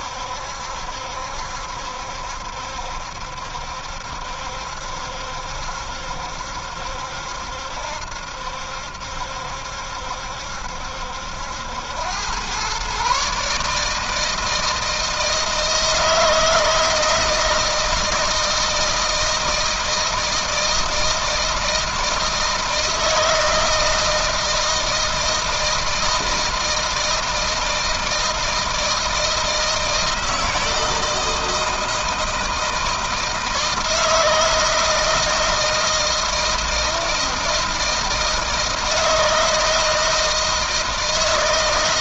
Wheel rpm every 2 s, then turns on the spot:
70, 70, 70, 70, 70, 70, 120, 160, 160, 160, 160, 160, 160, 160, 160, 170, 160, 160, 160, 160, 160.
none